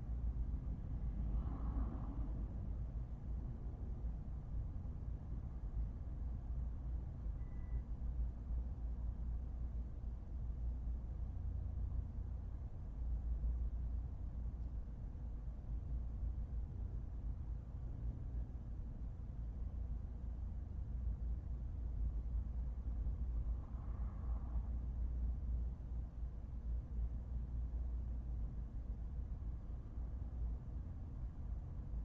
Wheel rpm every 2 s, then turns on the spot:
0, 0, 0, 0, 0, 0, 0, 0, 0, 0, 0, 0, 0, 0, 0, 0.
none